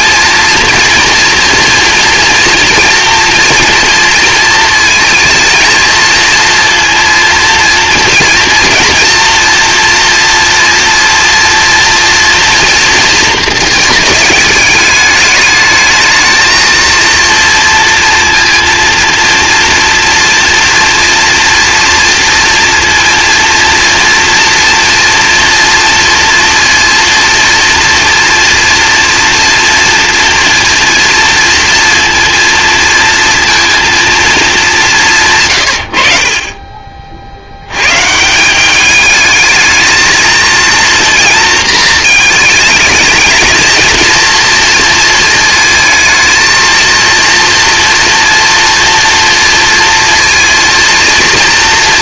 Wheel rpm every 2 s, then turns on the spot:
230, 230, 220, 230, 230, 230, 230, 210, 220, 230, 240, 230, 230, 230, 230, 230, 230, 210, 30, 190, 230, 220, 230, 220, 230, 230.
none